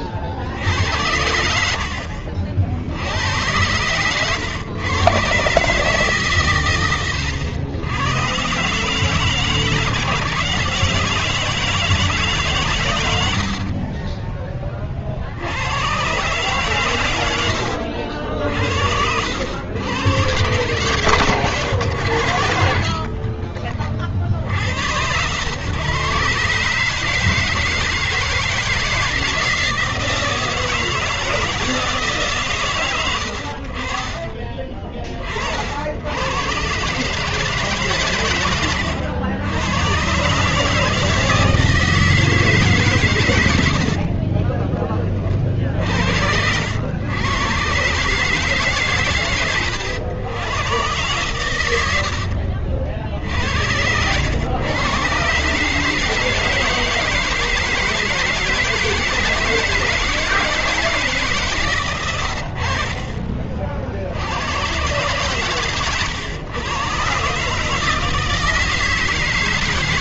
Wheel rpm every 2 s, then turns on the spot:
40, 70, 130, 130, 130, 150, 130, 30, 120, 70, 130, 90, 80, 140, 170, 160, 110, 30, 150, 110, 160, 120, 40, 110, 120, 110, 60, 130, 160, 160, 150, 50, 110, 130, 160.
62-64